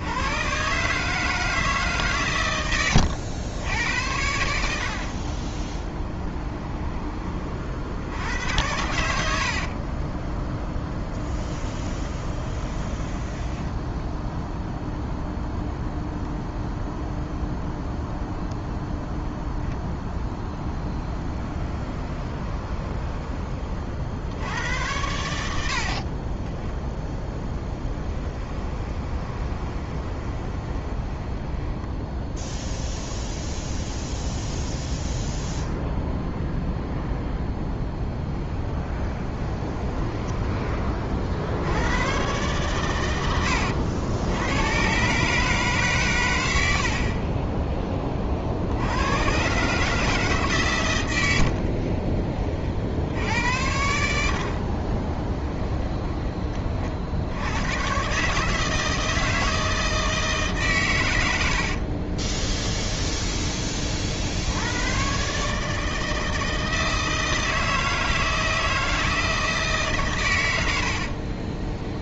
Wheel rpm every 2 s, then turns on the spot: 150, 90, 60, 20, 90, 0, 20, 0, 0, 0, 10, 20, 90, 10, 20, 20, 10, 0, 0, 10, 30, 120, 130, 60, 90, 110, 60, 30, 60, 160, 130, 10, 110, 160, 160, 60.
12-14 20-24 28-32 38-40 46-48 54-56 62-64